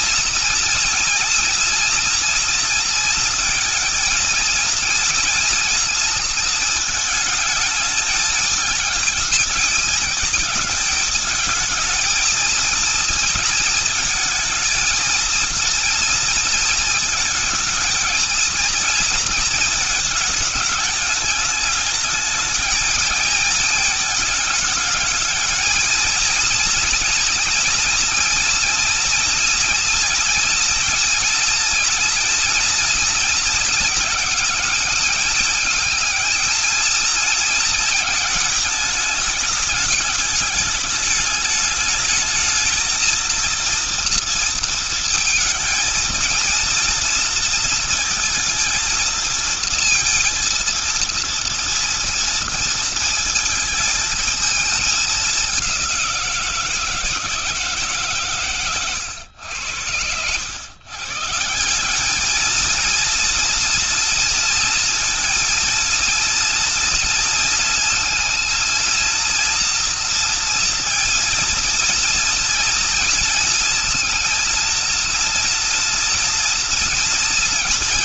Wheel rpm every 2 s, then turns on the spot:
230, 230, 230, 220, 220, 220, 220, 230, 230, 230, 210, 220, 220, 230, 230, 240, 230, 210, 220, 210, 210, 230, 230, 230, 230, 230, 230, 210, 160, 120, 130, 230, 230, 230, 230, 230, 230, 230, 230.
none